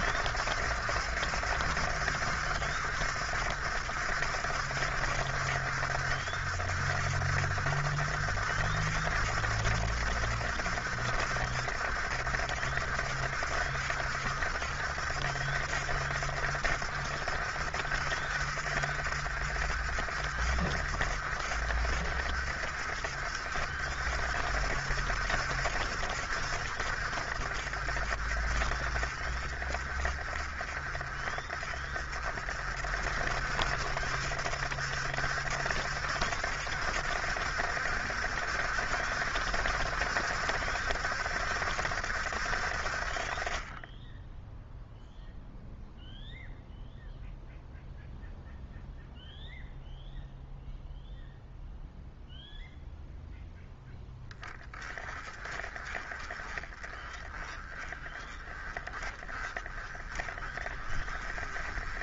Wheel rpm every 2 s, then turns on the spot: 70, 70, 60, 60, 70, 60, 60, 60, 60, 60, 60, 60, 60, 60, 50, 40, 60, 70, 70, 70, 70, 60, 0, 0, 0, 0, 0, 10, 20, 20, 30.
none